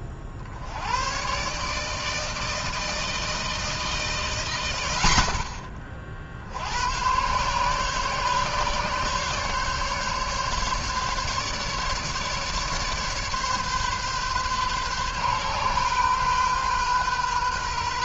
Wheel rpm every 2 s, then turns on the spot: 60, 160, 130, 60, 140, 140, 150, 130, 130.
none